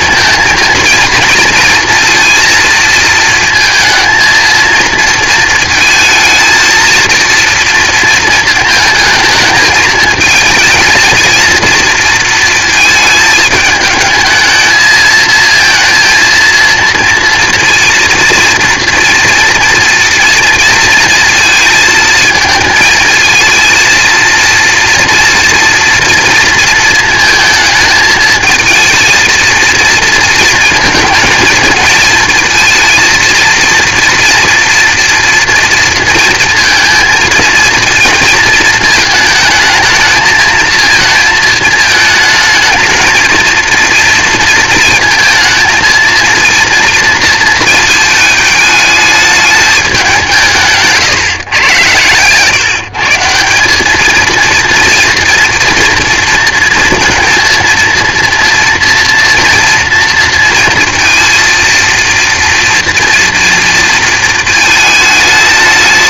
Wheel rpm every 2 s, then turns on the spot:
230, 230, 230, 230, 220, 220, 230, 220, 230, 230, 230, 220, 230, 230, 230, 230, 230, 230, 230, 230, 220, 220, 230, 230, 220, 160, 150, 230, 230, 230, 230, 230, 220.
none